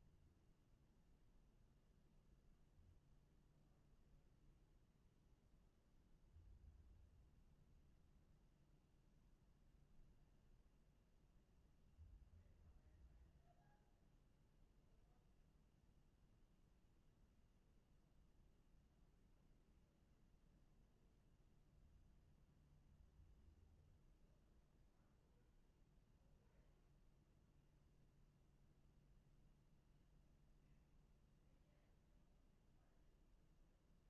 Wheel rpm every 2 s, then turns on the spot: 0, 0, 0, 0, 0, 0, 0, 0, 0, 0, 0, 0, 0, 0, 0, 0, 0.
none